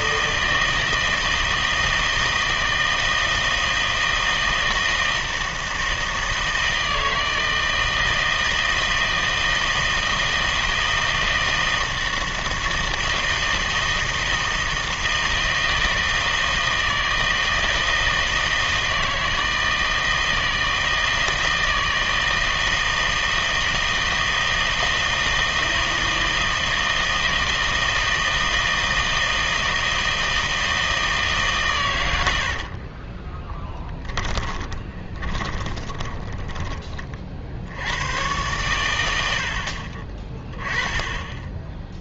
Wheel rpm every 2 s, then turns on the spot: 160, 160, 160, 160, 160, 160, 160, 160, 160, 160, 160, 160, 160, 160, 160, 160, 60, 20, 20, 100, 20.
32-36